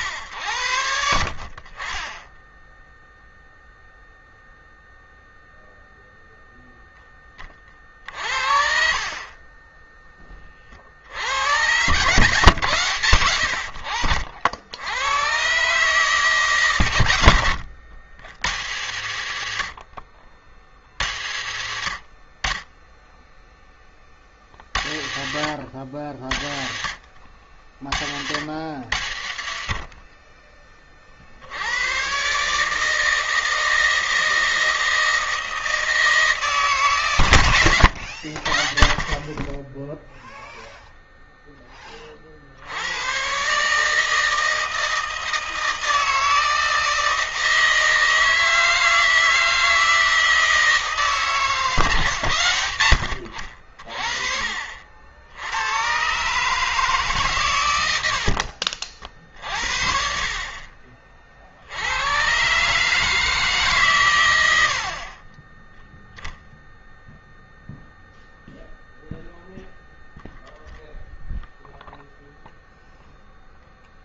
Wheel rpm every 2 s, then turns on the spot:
90, 0, 0, 0, 40, 40, 130, 80, 140, 130, 70, 60, 50, 70, 90, 10, 130, 160, 150, 70, 0, 70, 160, 160, 160, 160, 100, 50, 140, 60, 40, 130, 80, 0, 0, 0, 0.
58-60